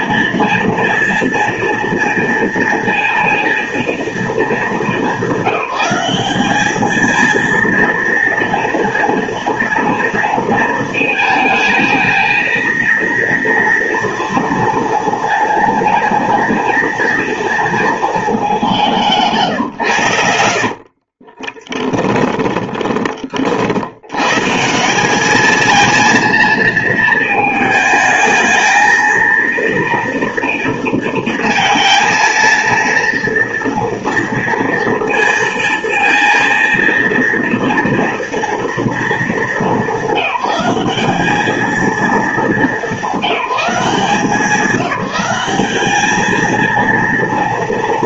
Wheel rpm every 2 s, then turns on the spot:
230, 230, 220, 200, 230, 230, 230, 230, 230, 210, 80, 10, 140, 230, 220, 230, 230, 230, 230, 230, 210, 210, 180, 220.
20-24